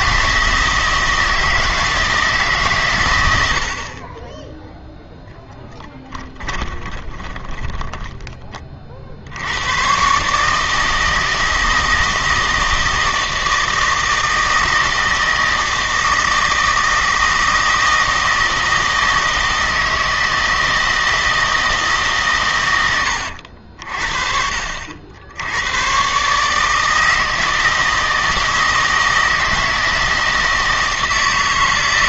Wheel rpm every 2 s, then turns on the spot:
160, 130, 0, 20, 30, 160, 160, 160, 160, 160, 160, 100, 60, 150, 160, 160.
6-8